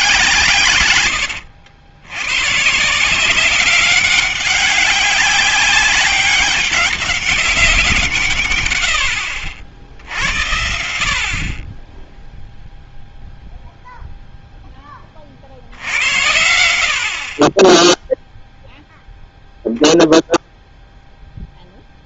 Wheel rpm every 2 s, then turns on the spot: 120, 140, 200, 200, 130, 80, 0, 0, 80, 0, 0.
none